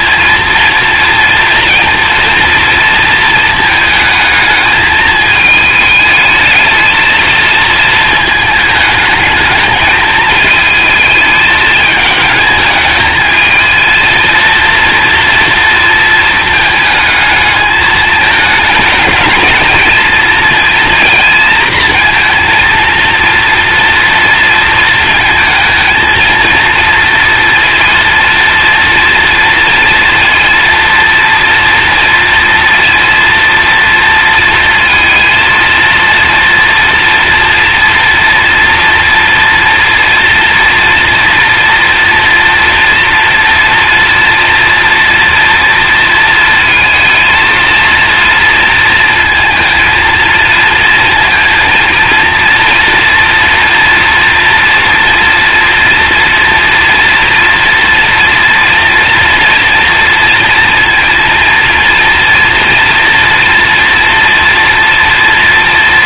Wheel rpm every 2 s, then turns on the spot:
230, 230, 220, 220, 220, 220, 220, 230, 220, 220, 230, 230, 230, 230, 230, 240, 230, 230, 230, 230, 230, 230, 230, 220, 230, 230, 230, 230, 240, 230, 230, 230, 230.
none